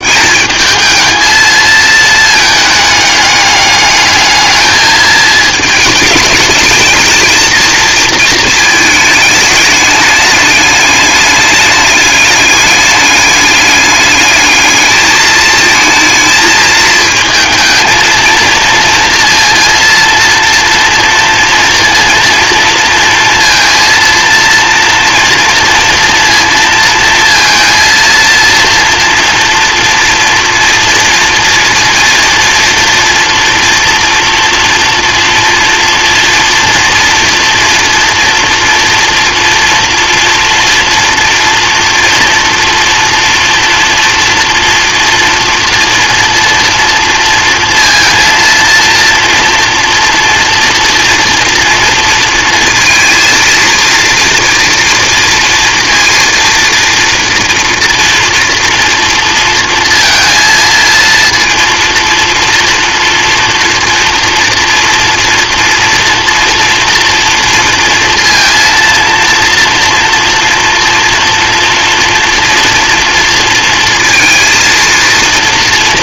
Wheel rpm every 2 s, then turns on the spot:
210, 210, 220, 220, 220, 210, 210, 210, 220, 230, 230, 230, 230, 230, 230, 230, 230, 230, 240, 240, 230, 230, 230, 230, 230, 230, 230, 240, 230, 230, 230, 240, 230, 230, 230, 230, 240, 230.
none